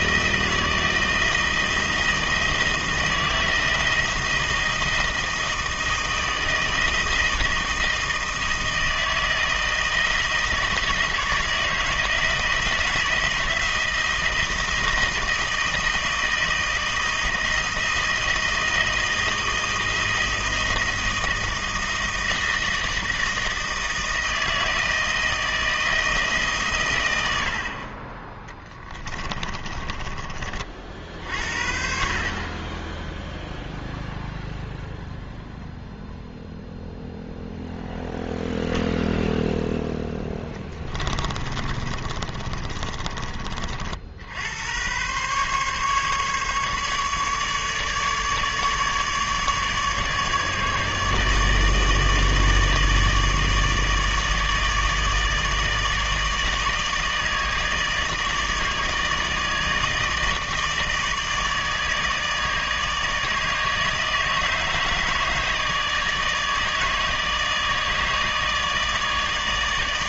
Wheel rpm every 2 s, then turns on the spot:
160, 160, 160, 160, 160, 160, 160, 160, 160, 160, 160, 160, 160, 140, 20, 40, 20, 0, 0, 0, 20, 30, 100, 150, 150, 150, 150, 160, 150, 150, 160, 150, 160, 150, 150.
28-30 40-44